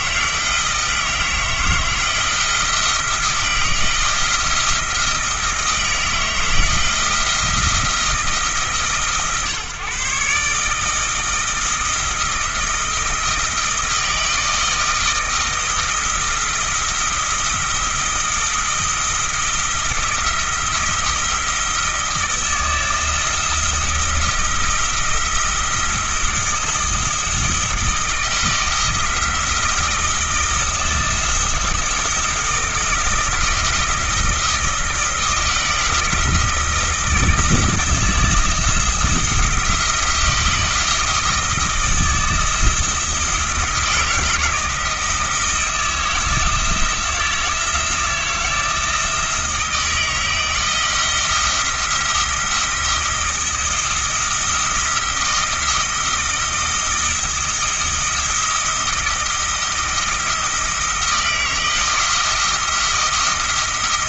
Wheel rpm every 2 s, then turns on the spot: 160, 170, 160, 160, 140, 160, 160, 160, 170, 170, 170, 160, 160, 160, 160, 160, 170, 160, 170, 170, 160, 160, 160, 160, 160, 160, 170, 170, 170, 170, 170, 170.
none